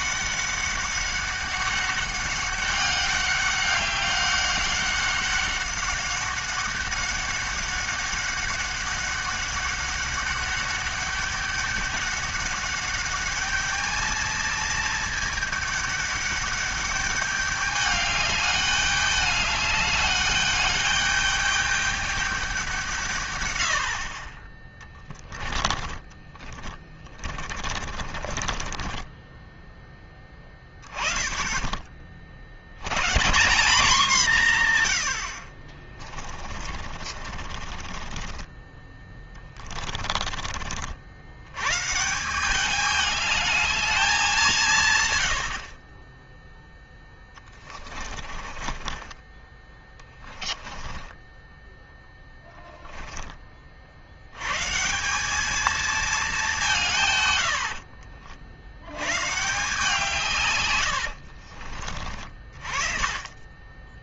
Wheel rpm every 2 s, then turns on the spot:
200, 200, 190, 190, 200, 200, 200, 220, 200, 200, 210, 160, 10, 20, 20, 20, 120, 90, 40, 20, 60, 210, 130, 10, 20, 10, 10, 170, 150, 110, 80, 30.
24-30 36-38 46-52 60-62